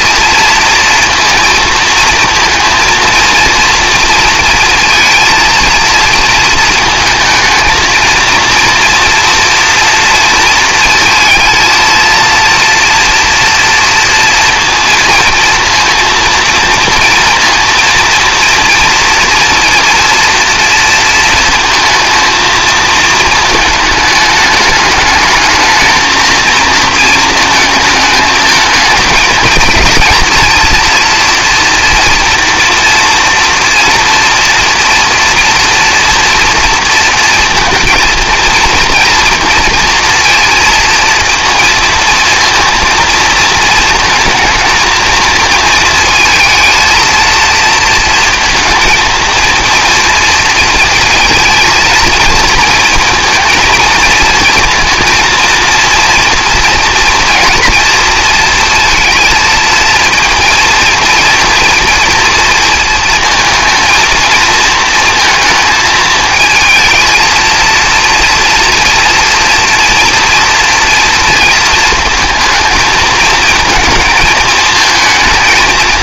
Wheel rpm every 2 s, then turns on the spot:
230, 220, 230, 220, 230, 230, 230, 230, 230, 230, 230, 230, 210, 220, 220, 230, 240, 230, 230, 230, 230, 230, 230, 230, 220, 230, 230, 230, 230, 230, 230, 230, 230, 220, 230, 230, 220, 220.
none